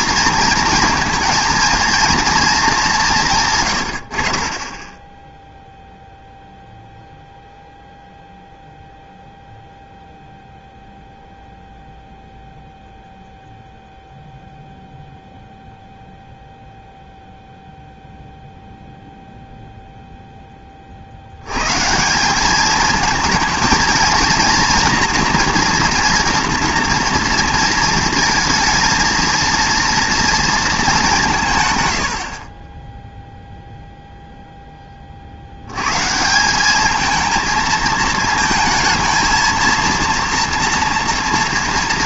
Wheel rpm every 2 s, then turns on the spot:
230, 230, 30, 0, 0, 0, 0, 0, 0, 0, 30, 210, 240, 240, 230, 220, 20, 10, 190, 220, 230.
none